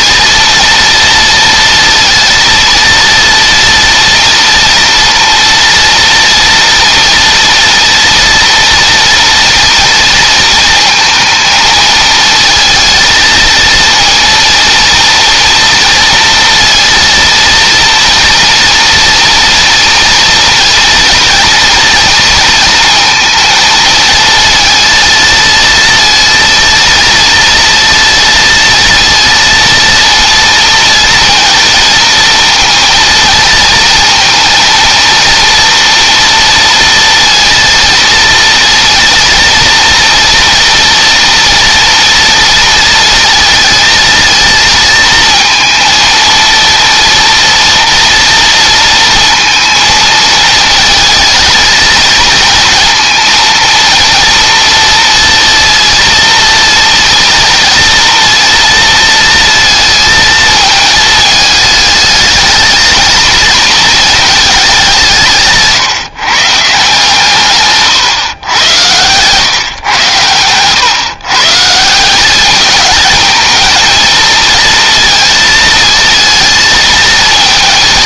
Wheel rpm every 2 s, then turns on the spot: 230, 230, 230, 230, 230, 230, 220, 230, 230, 230, 230, 220, 230, 230, 230, 230, 230, 230, 230, 240, 230, 230, 230, 230, 230, 220, 230, 230, 230, 230, 220, 220, 190, 160, 120, 140, 220, 230, 230.
none